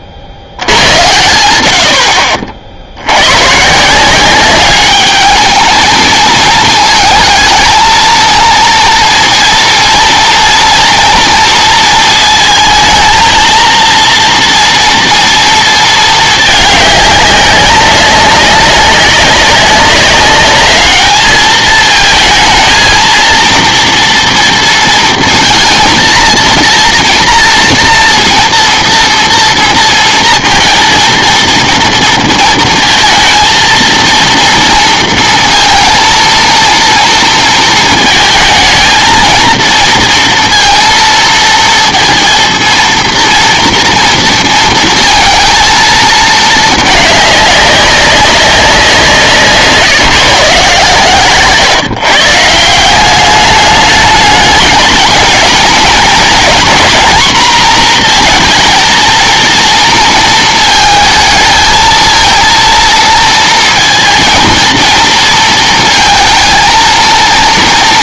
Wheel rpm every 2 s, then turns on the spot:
90, 60, 200, 220, 220, 230, 220, 230, 210, 200, 210, 220, 230, 230, 240, 230, 230, 230, 230, 220, 230, 230, 230, 220, 190, 140, 160, 220, 240, 230, 220, 230, 220, 230.
none